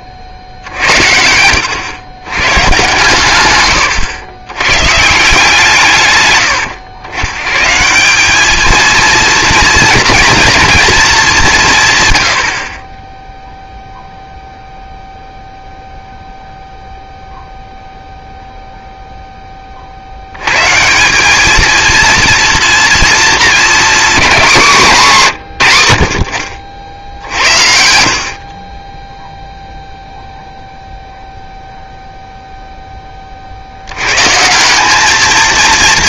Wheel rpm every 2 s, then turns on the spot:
70, 120, 100, 100, 210, 230, 50, 0, 0, 0, 110, 230, 210, 60, 30, 0, 0, 170.
none